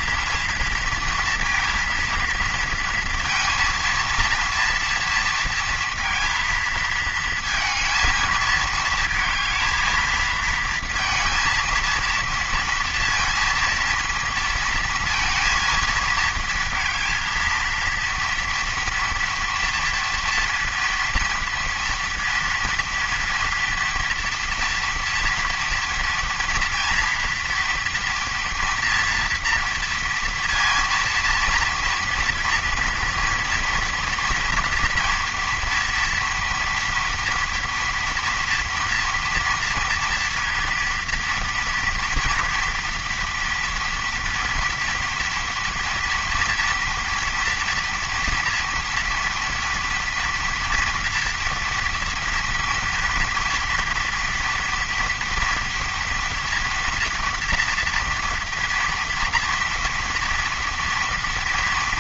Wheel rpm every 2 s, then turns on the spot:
230, 230, 230, 230, 220, 230, 230, 230, 230, 230, 230, 230, 230, 230, 230, 230, 230, 240, 230, 230, 230, 240, 230, 240, 230, 230, 230, 230, 230, 240, 230.
none